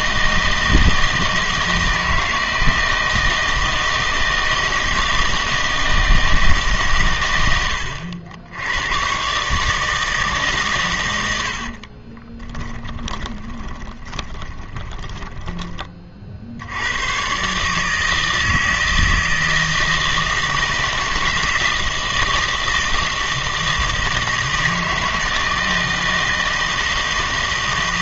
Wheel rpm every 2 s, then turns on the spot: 160, 160, 160, 150, 90, 140, 20, 20, 70, 160, 160, 160, 160, 160.
12-16